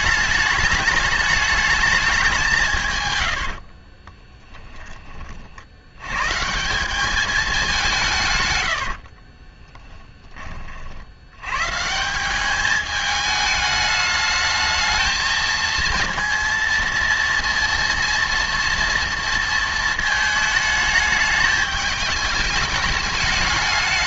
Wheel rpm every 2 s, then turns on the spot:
210, 130, 20, 190, 70, 70, 210, 220, 230, 230, 220, 210.
8-10